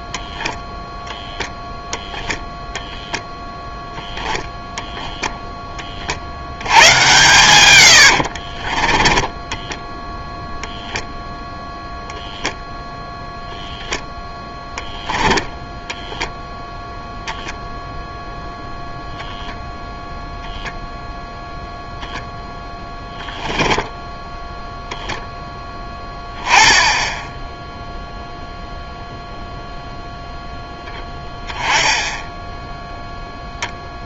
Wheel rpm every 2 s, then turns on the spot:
0, 0, 10, 90, 40, 0, 0, 0, 10, 0, 0, 0, 0, 10, 0, 0, 0.
8-10